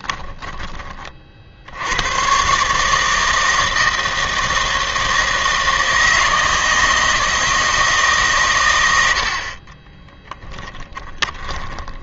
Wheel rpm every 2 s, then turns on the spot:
20, 140, 160, 160, 110, 20.
0-2 10-12